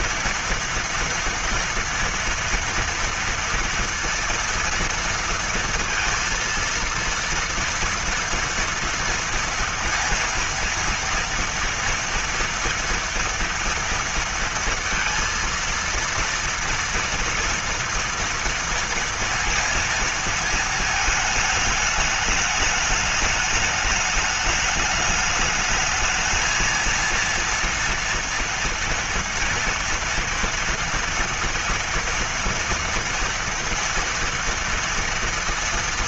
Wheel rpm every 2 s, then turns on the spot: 230, 230, 230, 230, 230, 230, 230, 230, 230, 230, 220, 220, 210, 220, 230, 230, 230, 230.
none